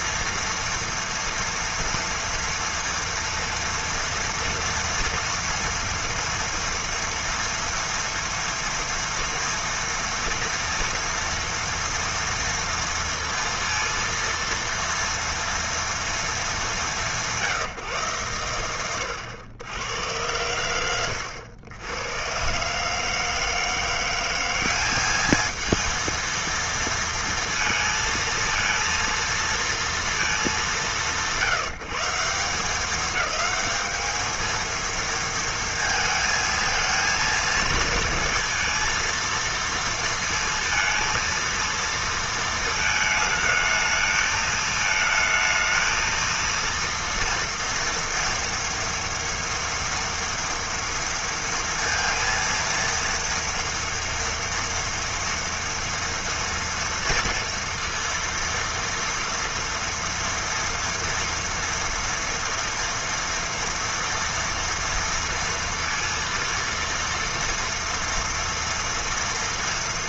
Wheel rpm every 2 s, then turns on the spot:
230, 230, 230, 230, 230, 230, 230, 230, 200, 120, 100, 130, 190, 230, 230, 210, 190, 230, 220, 230, 230, 220, 220, 230, 230, 230, 230, 230, 230, 230, 230, 230, 230, 230, 230.
none